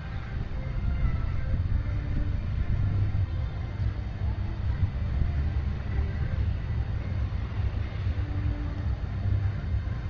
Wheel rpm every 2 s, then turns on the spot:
0, 0, 0, 0, 0.
none